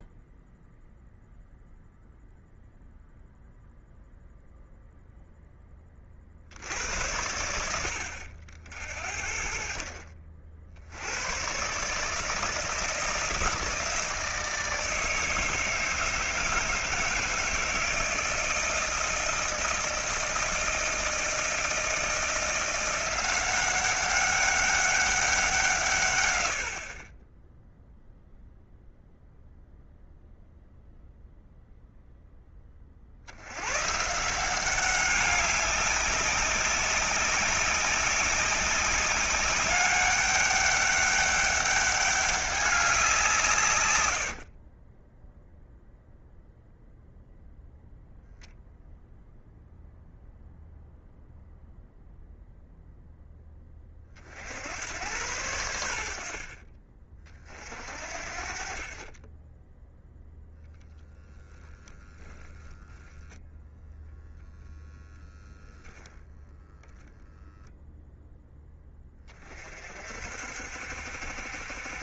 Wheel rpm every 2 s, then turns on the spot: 0, 0, 0, 80, 60, 60, 160, 160, 160, 160, 160, 170, 200, 70, 0, 0, 30, 180, 200, 190, 200, 190, 30, 0, 0, 0, 0, 70, 40, 40, 0, 10, 0, 10, 10, 60.
44-46 66-68